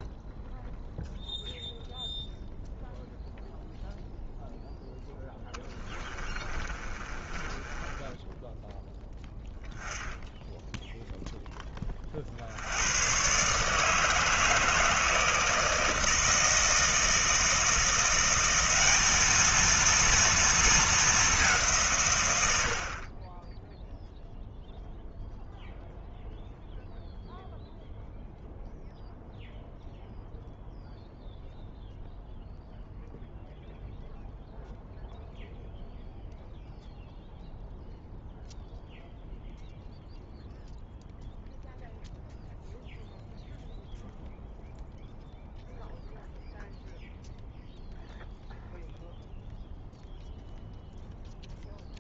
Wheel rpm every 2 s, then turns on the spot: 0, 0, 0, 30, 10, 0, 80, 160, 160, 190, 220, 80, 0, 0, 0, 0, 0, 0, 0, 0, 0, 0, 0, 0, 0, 0.
6-8